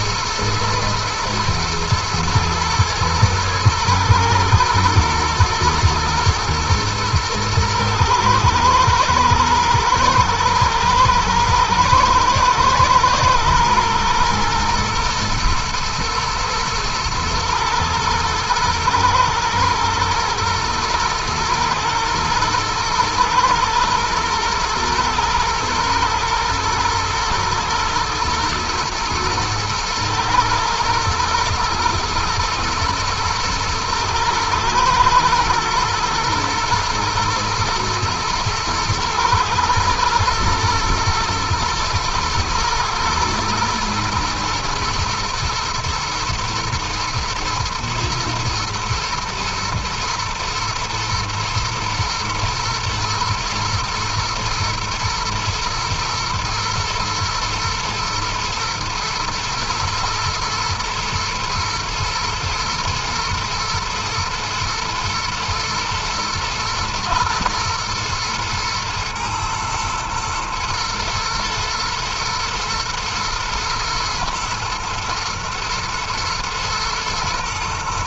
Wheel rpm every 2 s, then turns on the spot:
110, 110, 110, 110, 110, 110, 110, 110, 110, 110, 110, 110, 110, 110, 110, 110, 110, 110, 120, 110, 110, 110, 120, 110, 120, 110, 120, 120, 120, 110, 110, 110, 110, 120, 110, 110, 120, 110, 120.
none